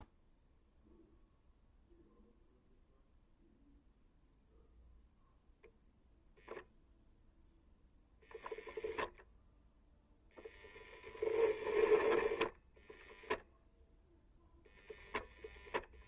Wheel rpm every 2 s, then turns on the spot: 0, 0, 0, 0, 0, 10, 0, 0.
10-12